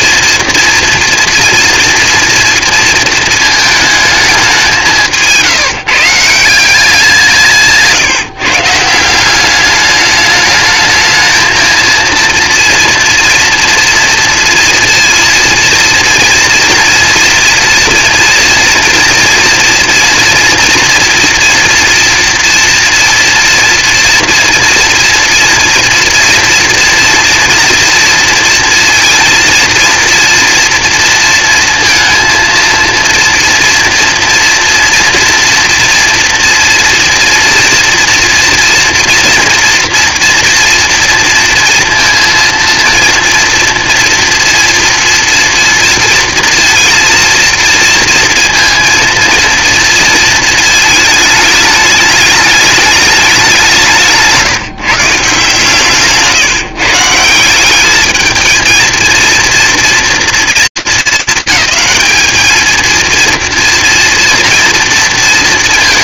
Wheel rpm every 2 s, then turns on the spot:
230, 230, 190, 180, 160, 210, 230, 230, 230, 240, 230, 230, 230, 230, 230, 230, 230, 230, 230, 230, 230, 230, 230, 230, 230, 220, 210, 160, 140, 220, 230, 220, 230.
none